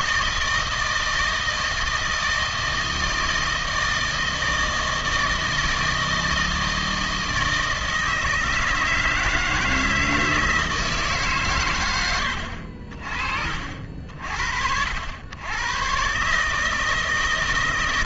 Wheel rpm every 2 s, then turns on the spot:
170, 160, 160, 160, 160, 160, 70, 70, 150.
none